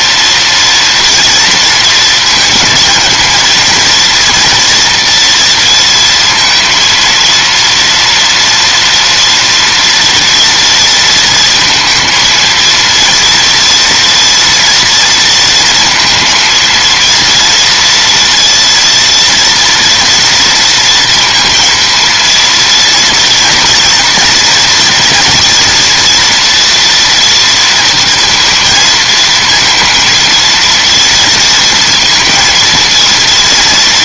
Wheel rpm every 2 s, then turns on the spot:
230, 220, 230, 230, 230, 230, 230, 230, 230, 230, 230, 230, 230, 240, 230, 230, 230.
none